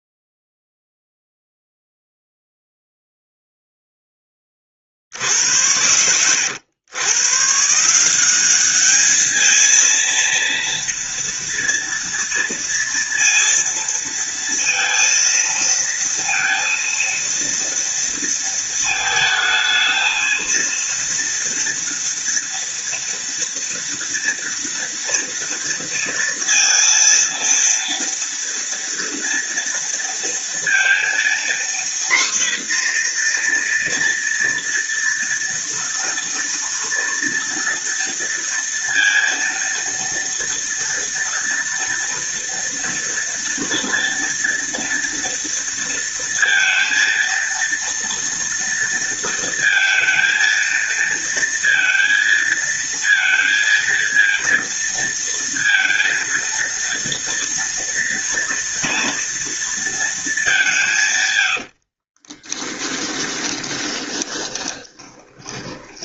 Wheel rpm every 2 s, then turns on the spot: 0, 0, 50, 110, 210, 230, 230, 230, 230, 230, 230, 230, 230, 230, 230, 230, 240, 240, 230, 230, 230, 230, 230, 230, 230, 230, 230, 230, 230, 230, 140, 10, 20.
62-66